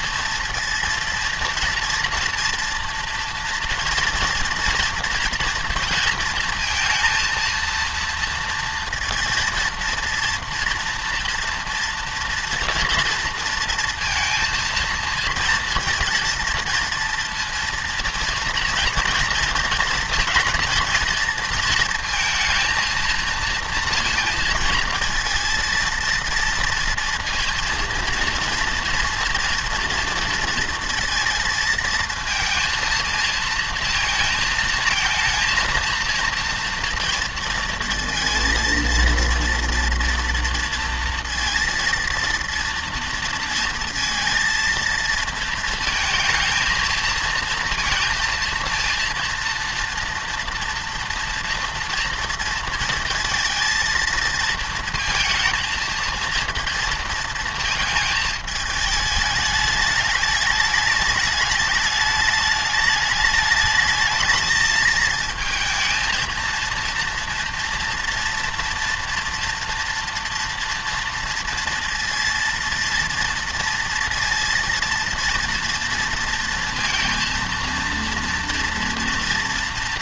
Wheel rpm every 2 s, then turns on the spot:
230, 240, 230, 230, 230, 240, 230, 230, 230, 230, 230, 220, 230, 230, 230, 230, 230, 220, 230, 230, 230, 230, 230, 230, 230, 230, 230, 220, 230, 220, 210, 210, 220, 230, 230, 240, 230, 230, 230, 240.
none